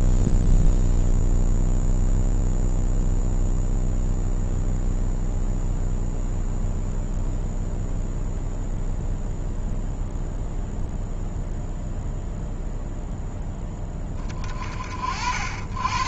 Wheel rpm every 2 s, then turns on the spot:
0, 0, 0, 0, 0, 0, 0, 40.
none